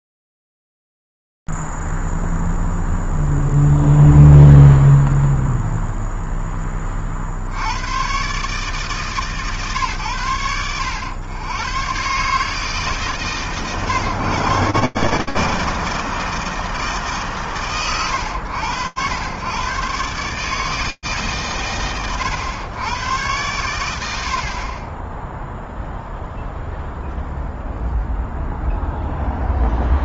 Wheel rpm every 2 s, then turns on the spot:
0, 0, 0, 10, 130, 100, 140, 140, 150, 90, 150, 100, 50, 0, 0.
none